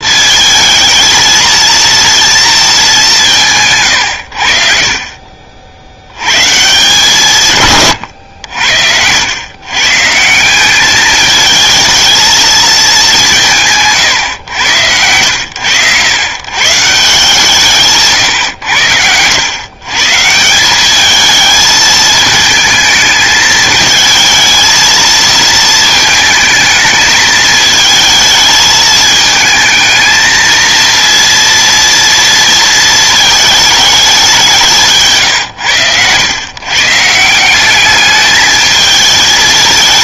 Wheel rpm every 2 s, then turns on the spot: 220, 220, 60, 140, 80, 190, 220, 110, 140, 100, 180, 220, 220, 220, 220, 230, 230, 170, 130, 220.
none